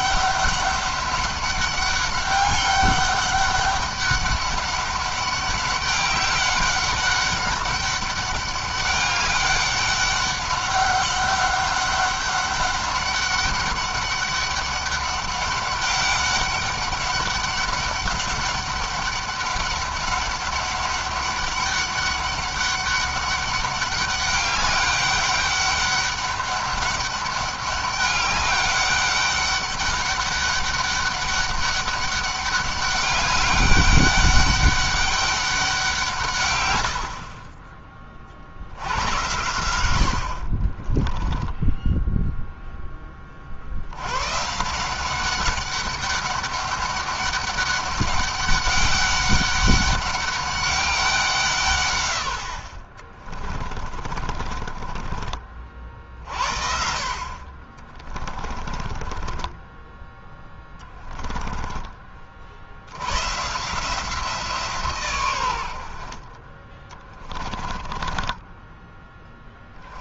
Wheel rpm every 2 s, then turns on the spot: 200, 200, 200, 200, 200, 200, 200, 200, 200, 200, 200, 200, 200, 200, 200, 200, 200, 200, 90, 70, 30, 10, 160, 200, 200, 200, 60, 30, 50, 20, 10, 60, 150, 30, 10.
40-42 54-56 58-62 68-70